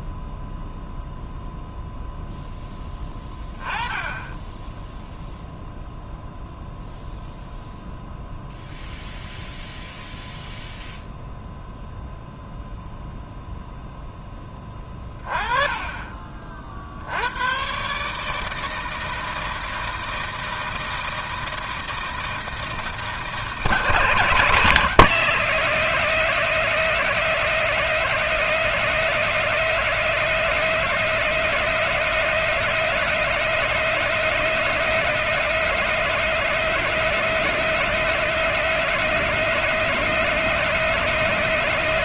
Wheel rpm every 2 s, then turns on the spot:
0, 10, 10, 0, 0, 0, 0, 20, 60, 160, 160, 160, 160, 180, 180, 180, 180, 180, 180, 180, 180.
14-16